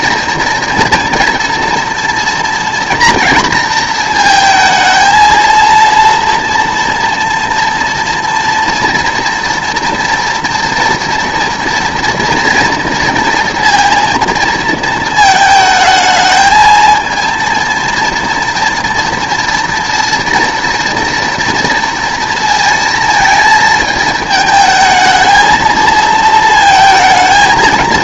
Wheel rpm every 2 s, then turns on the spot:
230, 230, 220, 230, 230, 230, 230, 220, 220, 240, 230, 230, 220, 220.
none